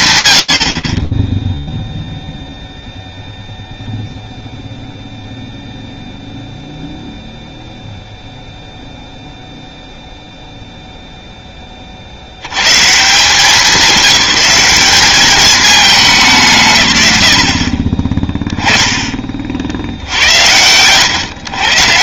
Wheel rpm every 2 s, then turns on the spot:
120, 0, 0, 0, 0, 0, 140, 210, 130, 10, 90.
none